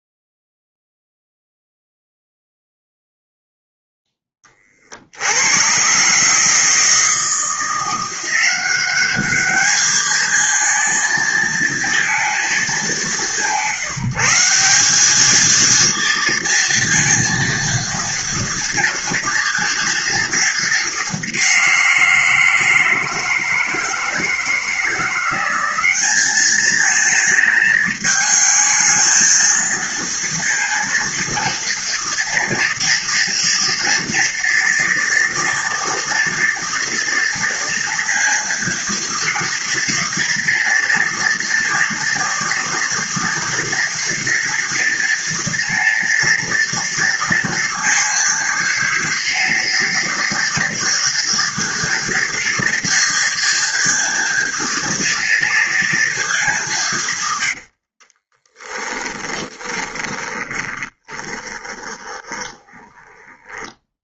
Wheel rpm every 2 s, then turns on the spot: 0, 0, 30, 150, 190, 230, 200, 180, 230, 230, 220, 170, 160, 210, 220, 230, 230, 230, 230, 230, 230, 230, 230, 230, 230, 230, 230, 230, 190, 10, 20, 20.
58-64